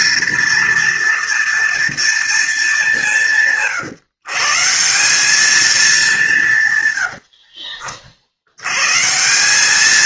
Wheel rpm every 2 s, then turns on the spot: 230, 190, 170, 120, 140.
6-8